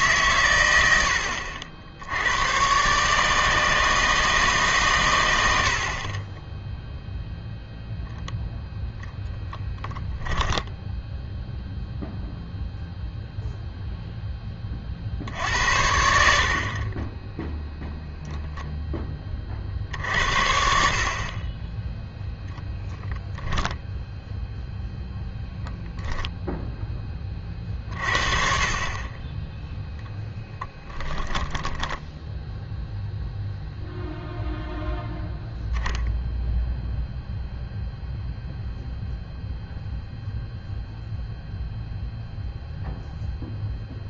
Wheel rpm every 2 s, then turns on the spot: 100, 110, 140, 10, 0, 10, 0, 30, 60, 0, 60, 0, 0, 10, 50, 10, 0, 0, 0, 0, 0, 0.
10-12 30-32